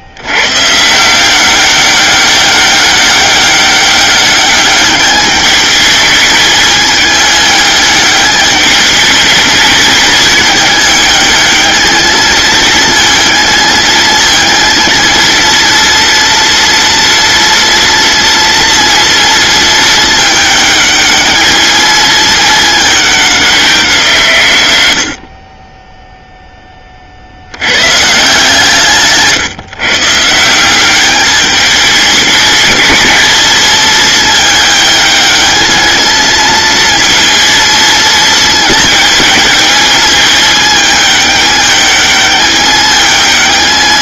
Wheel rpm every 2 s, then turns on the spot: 140, 190, 200, 220, 210, 210, 220, 230, 230, 230, 210, 210, 110, 20, 160, 190, 220, 220, 230, 220, 210, 210.
none